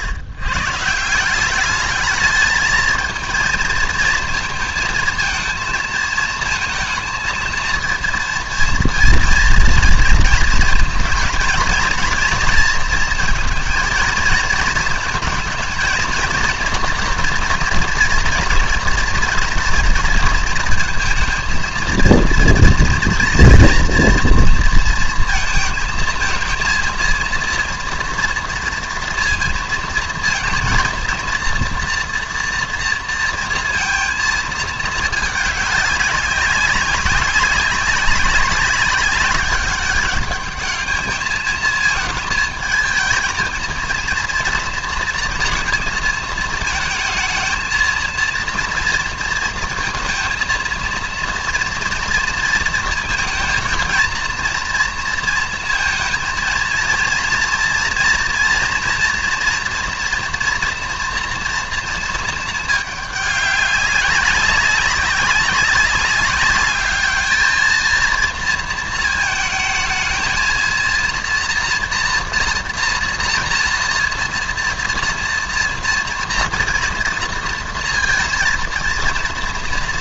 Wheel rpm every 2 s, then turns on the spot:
140, 220, 220, 220, 230, 220, 230, 220, 230, 230, 230, 230, 230, 230, 230, 230, 230, 220, 200, 200, 210, 220, 230, 220, 230, 230, 230, 230, 230, 230, 240, 210, 200, 200, 230, 230, 230, 230, 230, 220.
none